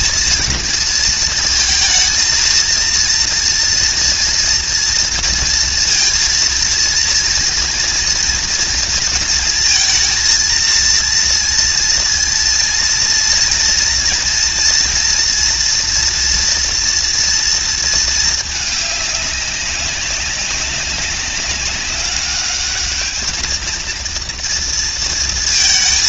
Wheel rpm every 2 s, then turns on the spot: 230, 230, 230, 230, 230, 230, 230, 230, 230, 200, 190, 220, 230.
none